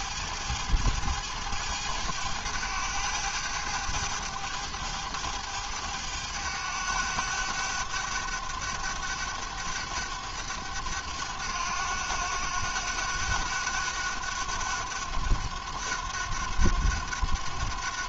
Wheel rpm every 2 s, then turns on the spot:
110, 100, 100, 100, 100, 100, 90, 100, 90.
none